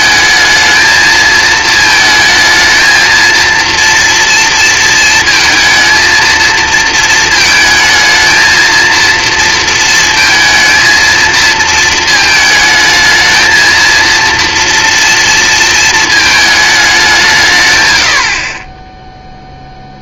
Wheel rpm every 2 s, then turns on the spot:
220, 220, 230, 230, 230, 230, 220, 230, 210, 20.
none